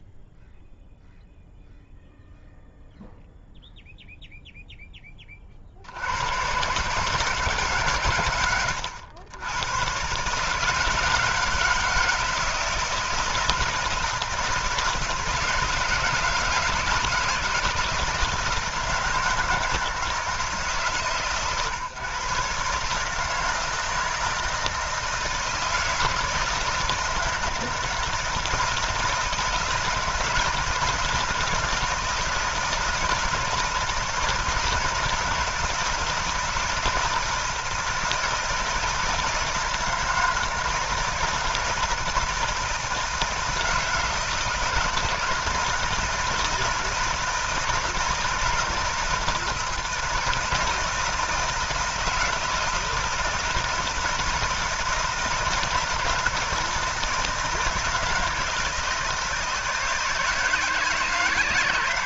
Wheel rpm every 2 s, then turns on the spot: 0, 0, 0, 130, 100, 150, 160, 160, 160, 160, 150, 140, 160, 160, 160, 160, 160, 160, 160, 160, 160, 170, 160, 160, 160, 160, 160, 160, 160, 160, 160.
none